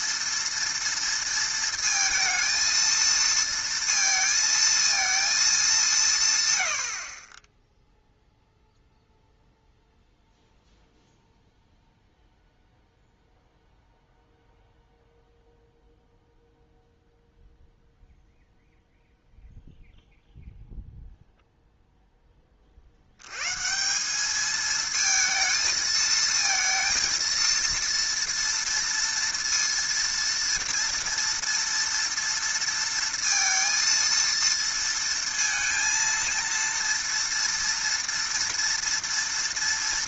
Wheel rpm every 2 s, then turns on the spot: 230, 230, 230, 130, 0, 0, 0, 0, 0, 0, 0, 30, 220, 230, 230, 230, 230, 230, 230, 230.
none